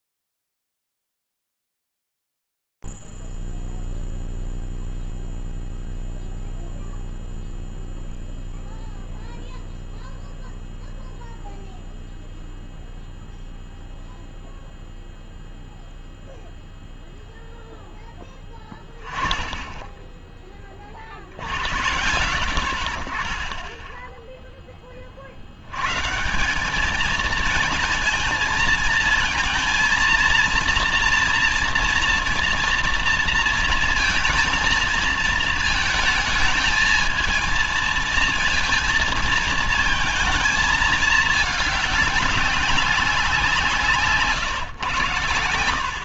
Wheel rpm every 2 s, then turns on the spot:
0, 0, 0, 0, 0, 0, 0, 0, 0, 10, 20, 70, 10, 170, 220, 230, 230, 230, 220, 230, 220, 210, 120.
none